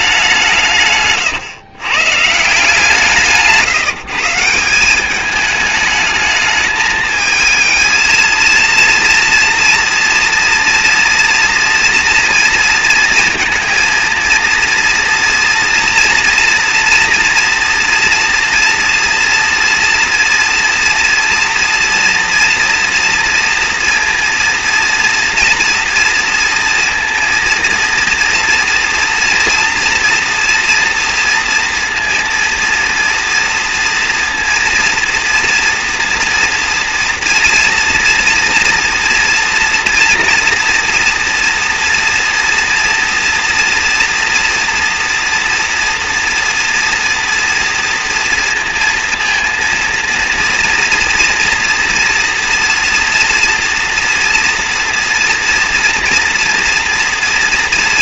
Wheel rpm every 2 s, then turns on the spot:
150, 160, 180, 210, 230, 230, 230, 230, 240, 230, 230, 240, 230, 230, 230, 230, 230, 230, 230, 230, 230, 230, 230, 240, 230, 230, 230, 240, 230.
none